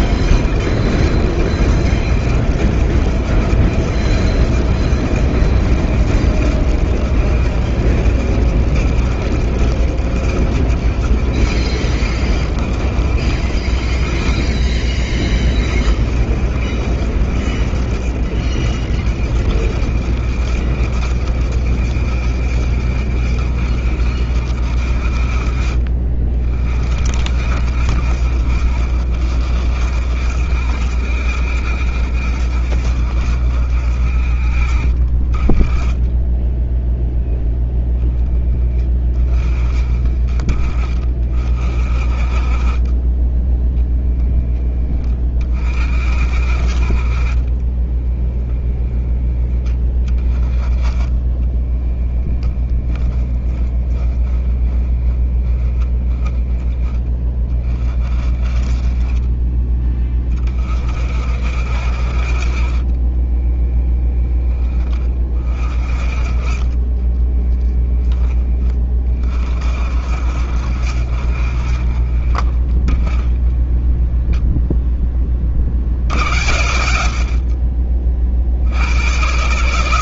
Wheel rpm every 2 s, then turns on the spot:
70, 70, 70, 70, 70, 70, 70, 40, 60, 60, 60, 70, 70, 50, 60, 70, 60, 40, 10, 10, 30, 30, 10, 50, 10, 10, 10, 10, 10, 20, 40, 40, 10, 30, 10, 50, 20, 0, 80, 40.
48-50 52-56 66-68